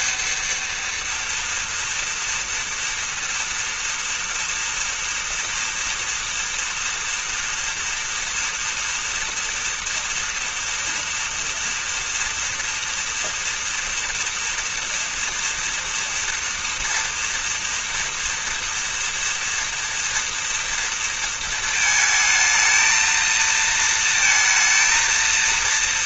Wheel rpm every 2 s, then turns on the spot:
230, 230, 230, 230, 230, 230, 240, 240, 230, 240, 240, 220, 230.
none